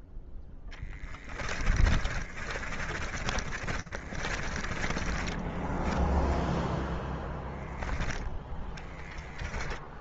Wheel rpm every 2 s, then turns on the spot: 10, 40, 30, 0, 10.
0-6 8-10